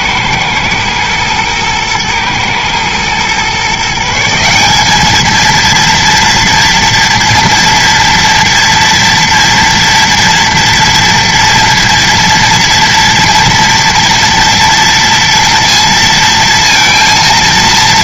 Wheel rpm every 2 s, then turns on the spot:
110, 110, 200, 230, 240, 230, 230, 230, 230.
none